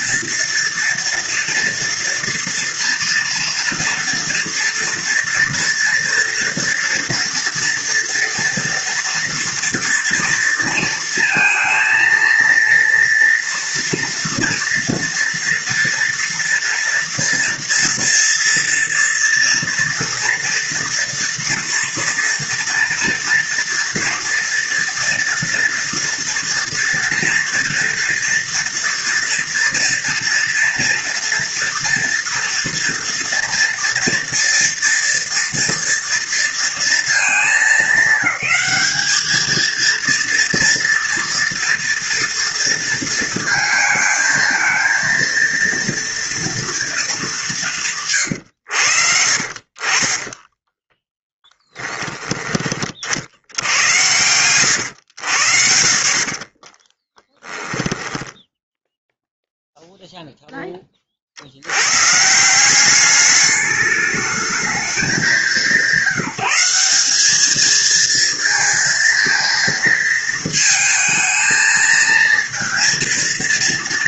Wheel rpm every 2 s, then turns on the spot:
230, 230, 230, 230, 230, 230, 230, 230, 230, 230, 230, 230, 230, 230, 230, 230, 230, 230, 210, 200, 230, 230, 230, 230, 100, 10, 20, 110, 20, 0, 20, 190, 220, 200, 230, 220, 230.
50-52 56-58